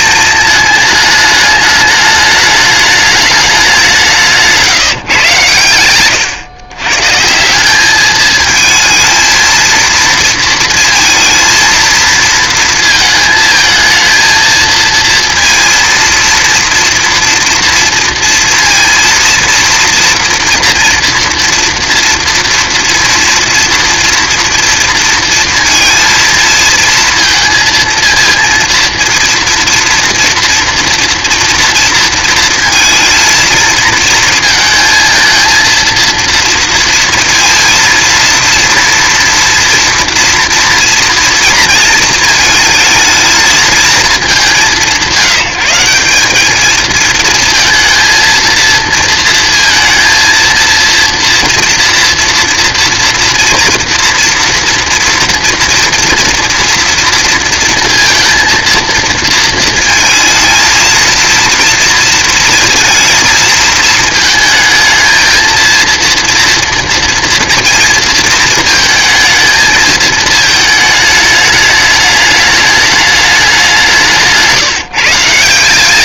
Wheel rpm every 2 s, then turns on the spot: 220, 210, 160, 140, 220, 230, 220, 230, 230, 230, 240, 230, 230, 230, 230, 230, 230, 230, 230, 240, 230, 230, 180, 220, 230, 230, 230, 230, 230, 230, 230, 220, 220, 230, 220, 210, 210, 160.
none